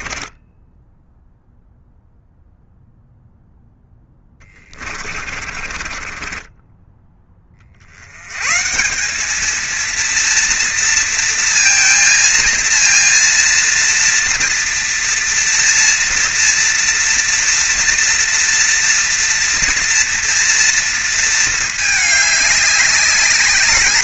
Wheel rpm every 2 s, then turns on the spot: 10, 0, 20, 20, 170, 230, 230, 230, 230, 240, 230, 210.
0-2 4-8